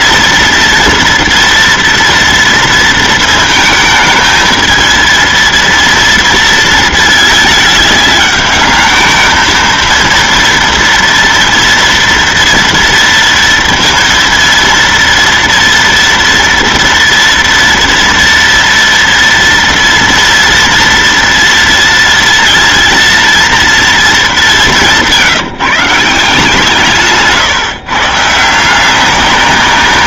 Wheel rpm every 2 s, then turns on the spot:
230, 230, 230, 220, 210, 240, 230, 230, 230, 230, 230, 230, 170, 150, 190.
24-26